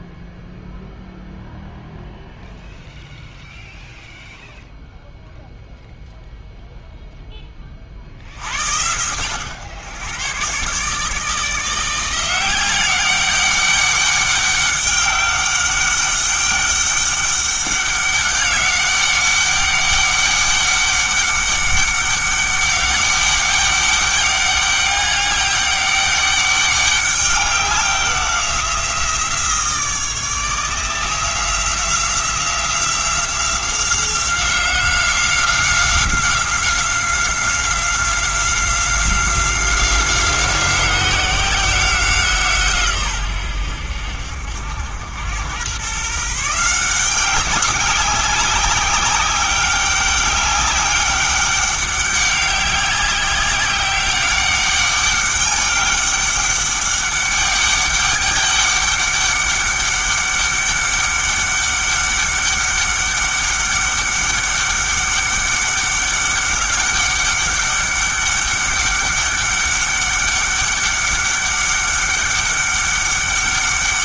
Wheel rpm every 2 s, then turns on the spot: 0, 0, 0, 0, 80, 130, 180, 200, 200, 200, 200, 200, 200, 200, 180, 160, 180, 180, 190, 180, 180, 150, 80, 170, 190, 200, 200, 200, 200, 200, 200, 200, 200, 200, 200, 200, 200.
none